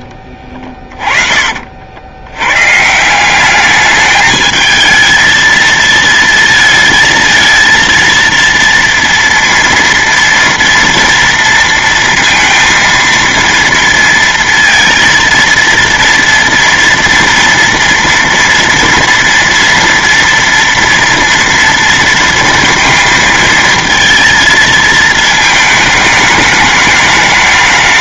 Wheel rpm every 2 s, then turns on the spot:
40, 120, 220, 230, 230, 230, 230, 230, 230, 230, 230, 230, 230, 210.
0-2